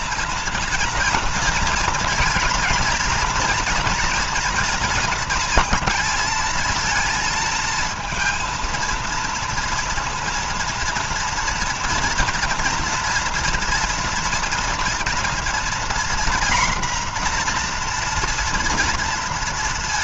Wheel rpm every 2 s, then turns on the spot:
230, 230, 230, 220, 230, 230, 230, 230, 240, 230.
none